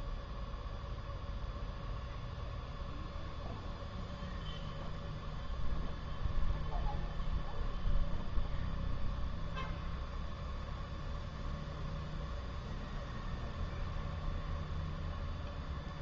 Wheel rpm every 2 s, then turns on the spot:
0, 0, 0, 0, 0, 0, 0, 0.
none